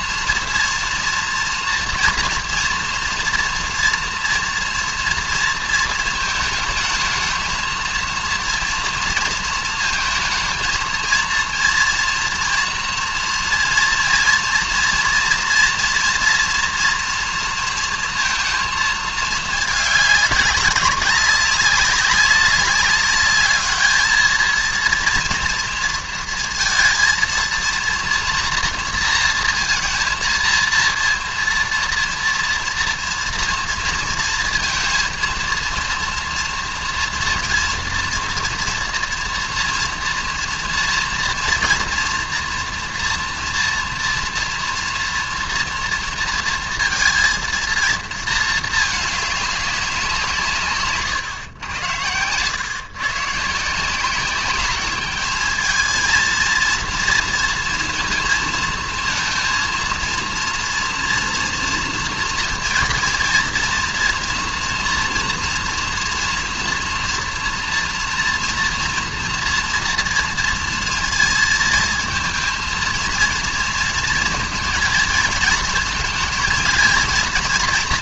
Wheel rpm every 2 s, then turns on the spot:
230, 230, 240, 220, 230, 230, 230, 230, 230, 220, 200, 200, 230, 230, 230, 230, 230, 230, 230, 230, 240, 230, 230, 230, 220, 140, 120, 200, 230, 230, 230, 230, 230, 230, 230, 230, 230, 230, 220.
none